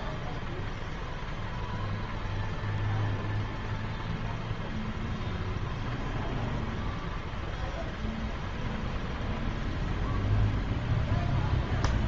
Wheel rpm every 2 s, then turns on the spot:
0, 0, 0, 0, 0, 0.
none